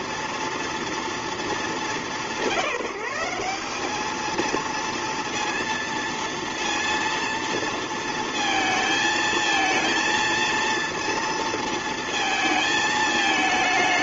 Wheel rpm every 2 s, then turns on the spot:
230, 180, 230, 230, 230, 230, 220.
none